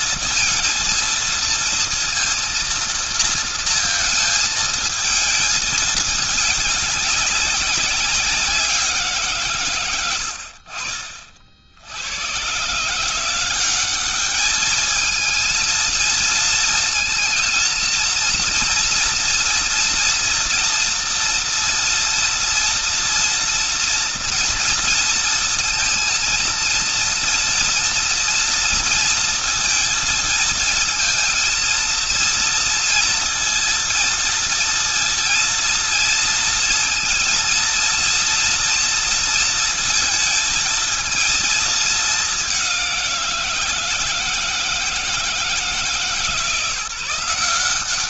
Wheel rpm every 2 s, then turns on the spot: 230, 230, 220, 210, 190, 60, 120, 210, 230, 230, 240, 230, 240, 230, 230, 230, 230, 230, 230, 230, 220, 190, 160, 160.
none